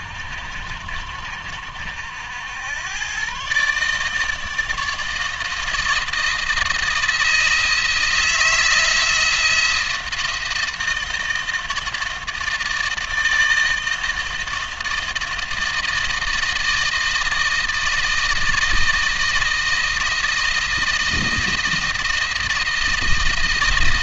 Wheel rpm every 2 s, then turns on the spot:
70, 100, 160, 170, 160, 160, 160, 160, 160, 160, 160, 170.
none